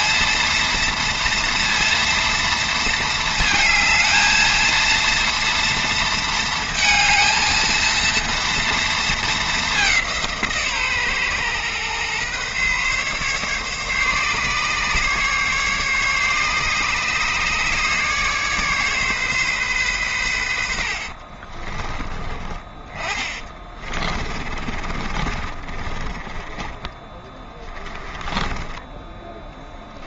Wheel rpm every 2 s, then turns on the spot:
230, 230, 230, 230, 230, 170, 130, 150, 150, 150, 100, 30, 30, 20, 20.
22-30